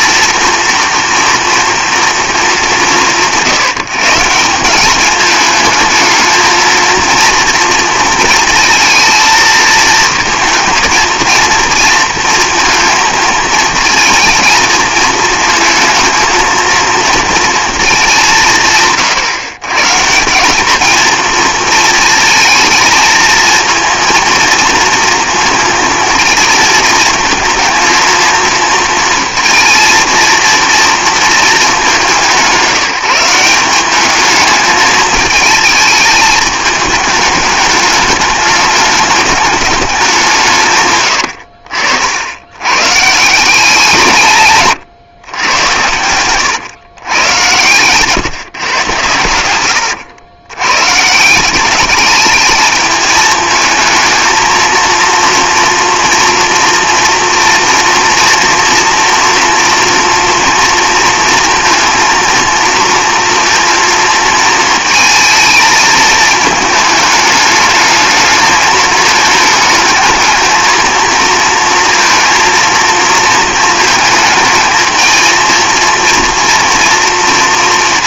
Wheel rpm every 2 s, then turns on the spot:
230, 210, 180, 230, 230, 230, 230, 220, 230, 170, 200, 230, 230, 220, 220, 230, 170, 210, 220, 210, 150, 90, 140, 120, 130, 110, 210, 220, 230, 230, 230, 230, 220, 220, 220, 220, 230, 220, 230.
none